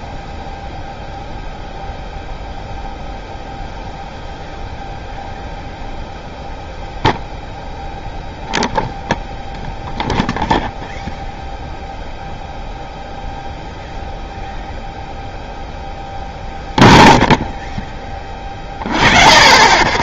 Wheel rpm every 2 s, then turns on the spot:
0, 0, 0, 0, 0, 0, 0, 0, 0, 20.
none